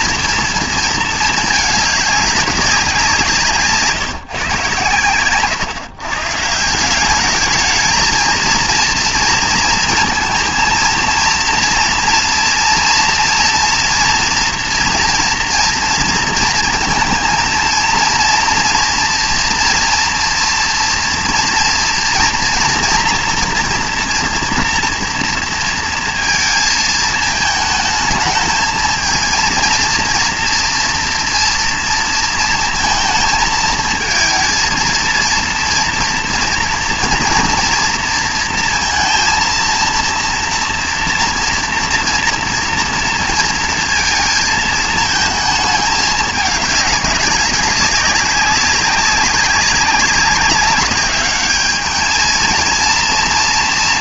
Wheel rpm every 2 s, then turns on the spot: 230, 190, 130, 150, 230, 230, 230, 230, 230, 230, 240, 230, 240, 230, 220, 240, 230, 230, 230, 230, 230, 230, 220, 210, 190, 200, 230.
none